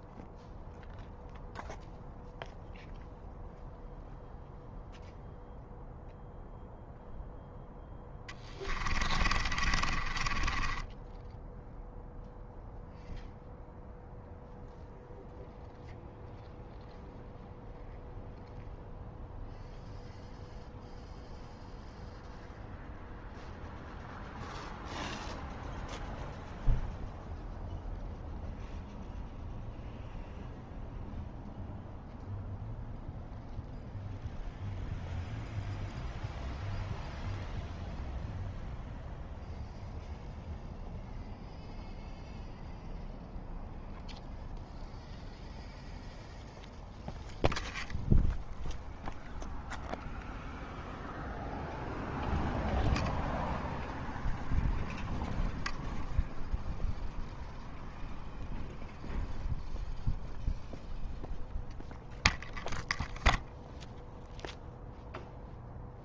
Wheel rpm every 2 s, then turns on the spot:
0, 0, 0, 0, 20, 10, 0, 0, 0, 0, 0, 0, 0, 0, 0, 0, 0, 0, 0, 0, 0, 0, 0, 0, 0, 0, 0, 0, 0, 0, 0, 0, 0.
8-10